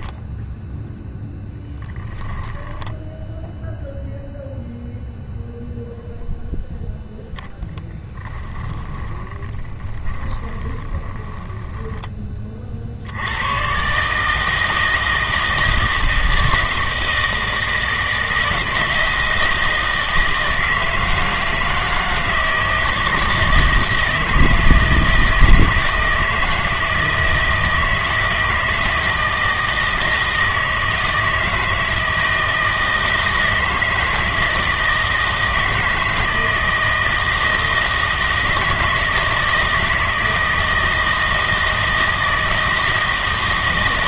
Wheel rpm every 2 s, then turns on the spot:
0, 10, 0, 0, 10, 20, 60, 160, 160, 160, 160, 160, 160, 160, 160, 160, 160, 160, 160, 160, 160, 160.
2-4 8-12